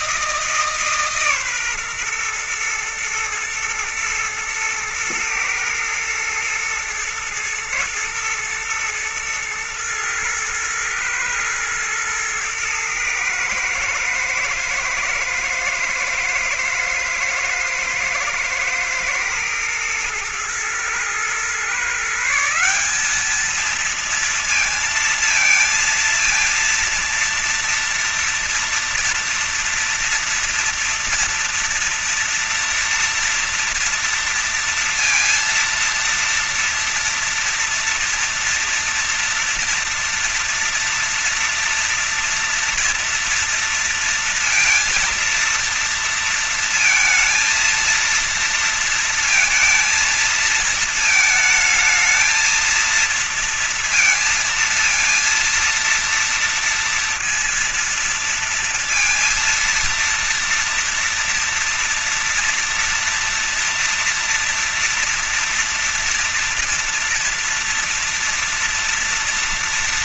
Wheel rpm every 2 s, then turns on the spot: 150, 120, 110, 110, 110, 110, 110, 120, 120, 110, 120, 190, 230, 230, 230, 230, 230, 230, 230, 230, 240, 230, 230, 220, 230, 220, 230, 230, 230, 230, 230, 230, 230, 230, 230.
none